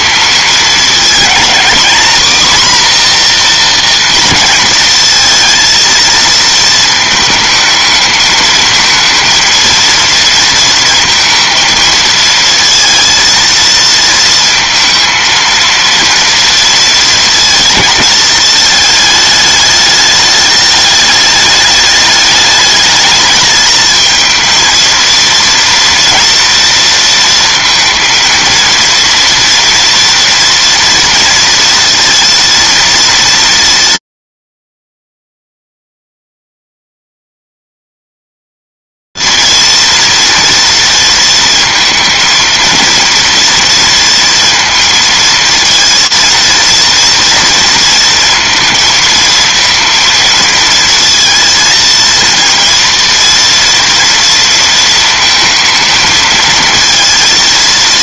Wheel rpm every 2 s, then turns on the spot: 220, 240, 220, 220, 220, 230, 230, 230, 230, 220, 210, 210, 230, 230, 230, 230, 230, 220, 250, 250, 230, 230, 240, 230, 230, 230, 230, 230, 220.
none